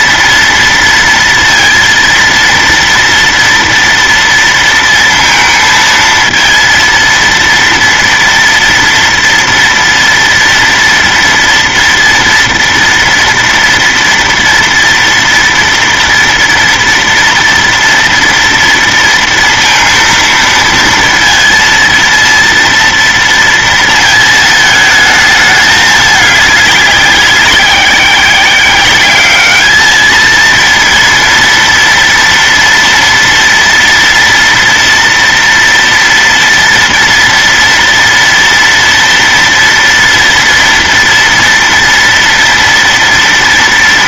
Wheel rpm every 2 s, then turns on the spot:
230, 230, 230, 230, 230, 230, 230, 230, 230, 230, 230, 230, 220, 210, 190, 220, 230, 230, 230, 230, 230, 230.
none